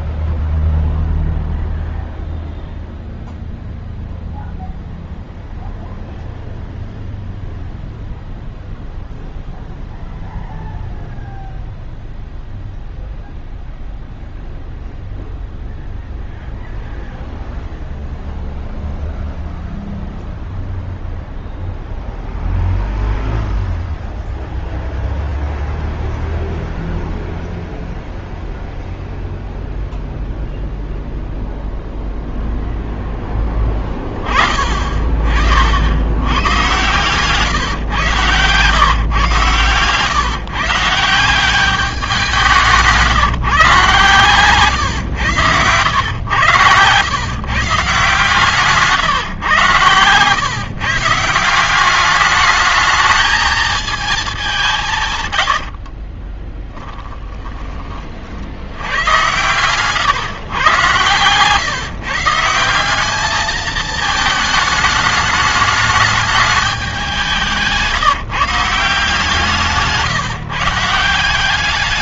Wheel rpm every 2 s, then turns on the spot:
0, 0, 0, 0, 0, 0, 0, 0, 0, 0, 0, 0, 0, 0, 0, 0, 20, 60, 130, 130, 190, 150, 110, 140, 130, 180, 220, 100, 20, 120, 130, 210, 210, 180, 160, 180.
54-58